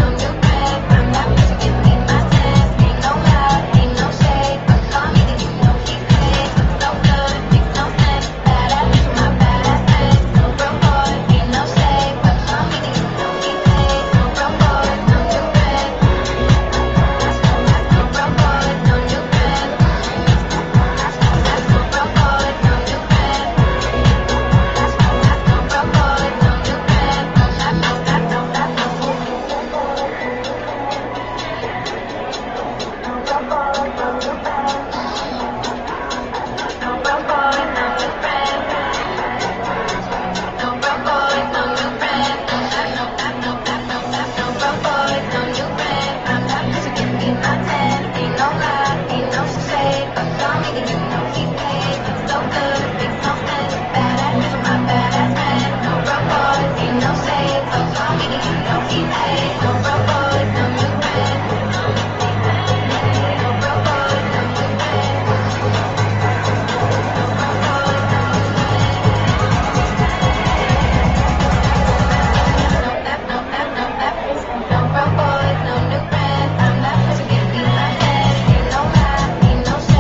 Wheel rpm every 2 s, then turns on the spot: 0, 0, 0, 0, 0, 0, 0, 0, 0, 0, 0, 0, 0, 0, 0, 0, 0, 0, 0, 0, 0, 0, 0, 0, 0, 0, 0, 0, 0, 0, 0, 0, 0, 0, 0, 0, 0, 0, 0, 0.
none